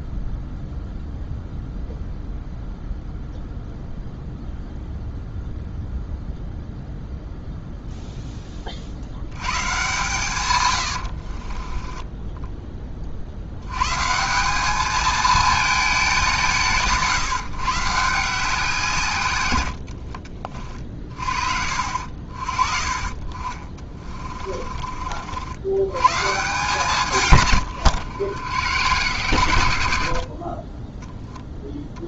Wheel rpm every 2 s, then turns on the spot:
0, 0, 0, 0, 40, 100, 20, 210, 140, 160, 40, 30, 40, 160, 100, 20.
10-12